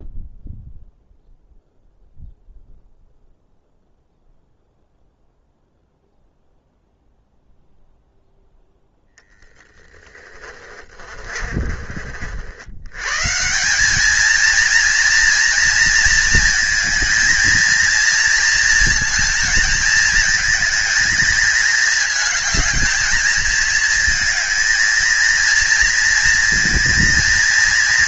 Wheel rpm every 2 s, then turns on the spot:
0, 0, 0, 0, 0, 30, 80, 230, 220, 230, 220, 220, 230, 230.
10-12